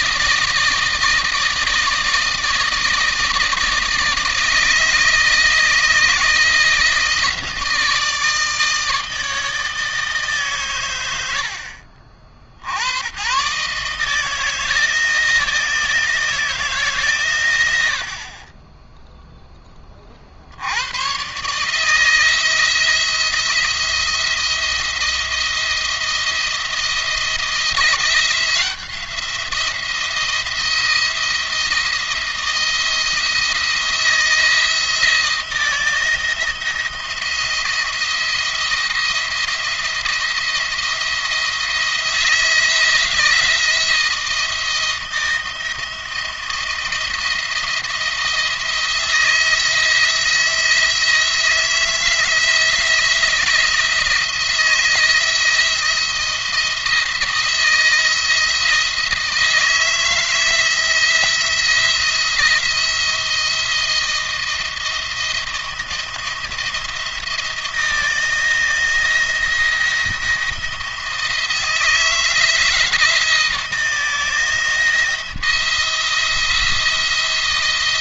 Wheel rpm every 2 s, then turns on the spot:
160, 160, 160, 160, 160, 120, 70, 160, 150, 20, 80, 170, 170, 170, 170, 170, 170, 160, 170, 170, 170, 170, 170, 170, 170, 160, 170, 160, 170, 160, 160, 170, 170, 170, 170, 160, 170, 170, 170.
none